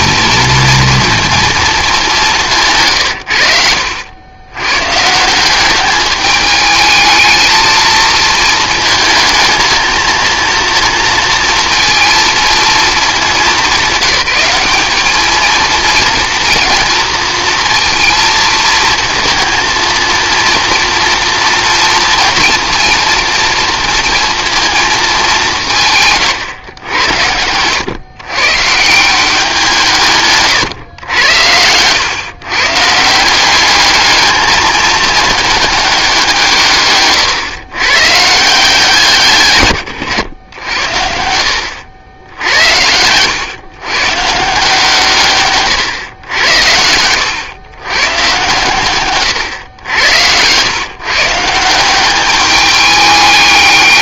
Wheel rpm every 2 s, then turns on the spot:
230, 150, 120, 210, 220, 230, 220, 200, 230, 230, 230, 230, 220, 100, 150, 130, 140, 210, 150, 160, 90, 90, 160, 90, 130, 130, 210.
46-48